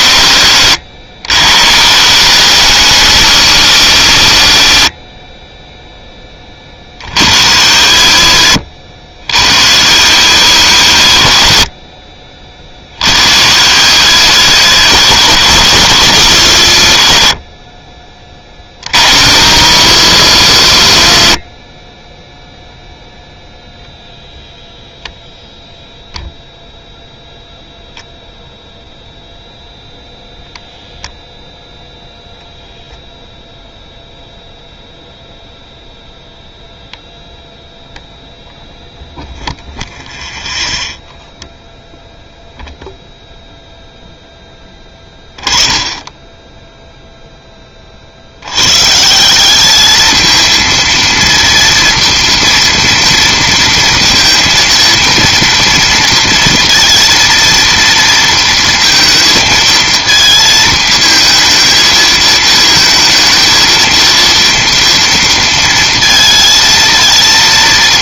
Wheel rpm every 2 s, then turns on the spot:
60, 90, 60, 30, 60, 90, 40, 100, 80, 30, 100, 0, 0, 0, 0, 0, 0, 0, 0, 0, 0, 0, 10, 0, 120, 230, 230, 230, 230, 230, 220, 230, 230, 230.
none